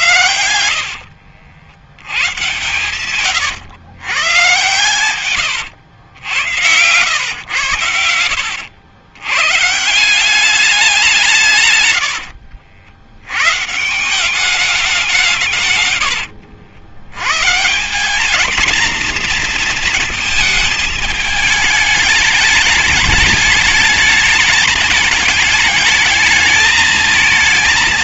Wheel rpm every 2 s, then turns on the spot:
100, 120, 110, 100, 90, 190, 80, 190, 80, 210, 230, 210, 220, 220.
0-4